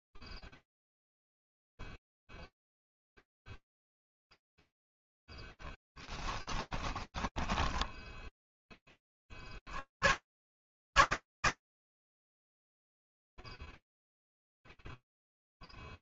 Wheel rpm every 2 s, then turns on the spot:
0, 0, 0, 10, 10, 120, 0, 0.
6-8